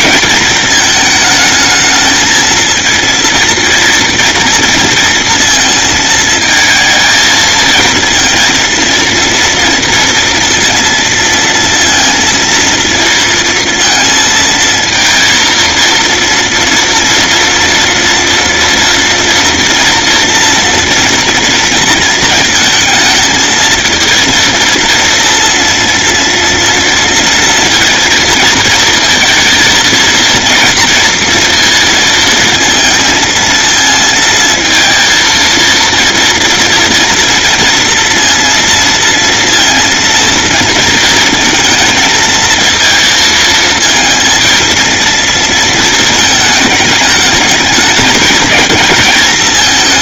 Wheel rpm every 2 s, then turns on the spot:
220, 230, 230, 220, 230, 230, 230, 230, 230, 230, 230, 220, 230, 230, 230, 240, 230, 220, 230, 230, 230, 230, 230, 210, 220.
none